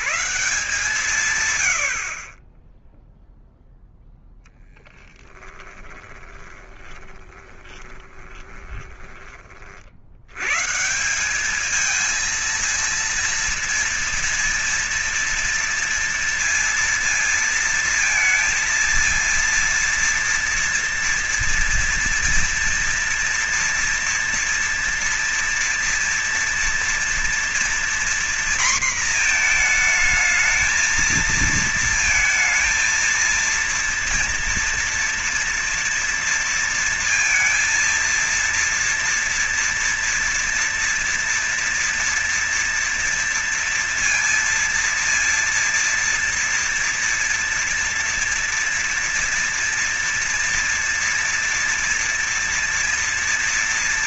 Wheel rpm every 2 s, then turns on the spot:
150, 0, 20, 20, 20, 160, 230, 230, 230, 230, 230, 230, 230, 230, 230, 220, 230, 230, 230, 230, 230, 230, 230, 230, 230, 230, 230.
4-10